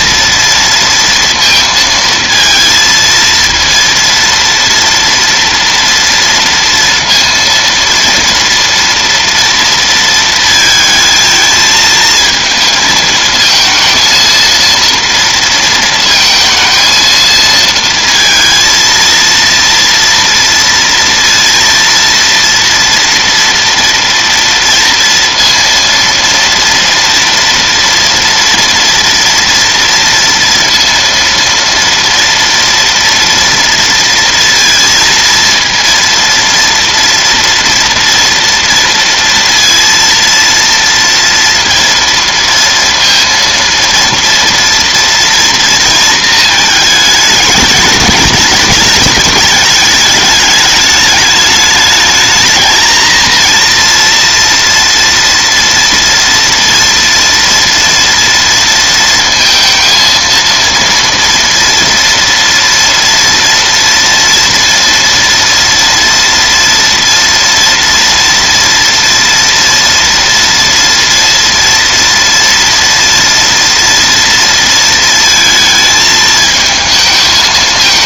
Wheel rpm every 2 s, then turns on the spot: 230, 230, 230, 230, 230, 220, 220, 230, 230, 230, 230, 230, 230, 240, 230, 230, 230, 230, 230, 230, 230, 230, 230, 220, 210, 210, 220, 230, 230, 230, 230, 230, 230, 230, 230, 230, 230, 230, 220.
none